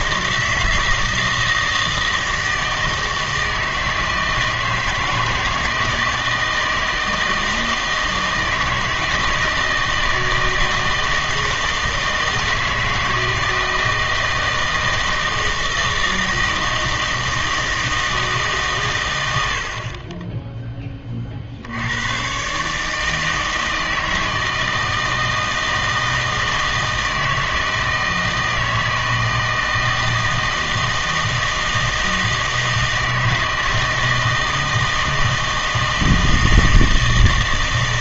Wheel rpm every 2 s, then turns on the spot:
160, 160, 160, 160, 160, 160, 160, 160, 160, 150, 10, 140, 160, 160, 160, 160, 160, 160, 160.
none